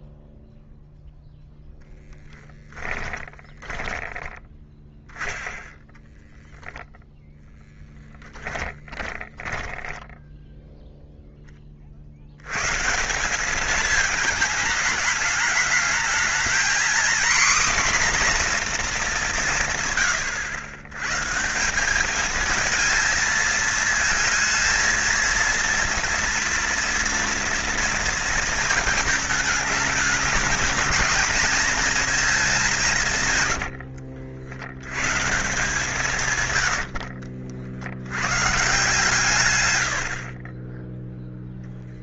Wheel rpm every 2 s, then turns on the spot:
0, 10, 10, 0, 20, 0, 130, 210, 230, 240, 110, 220, 230, 230, 220, 230, 190, 90, 100, 140, 10.
2-4 8-10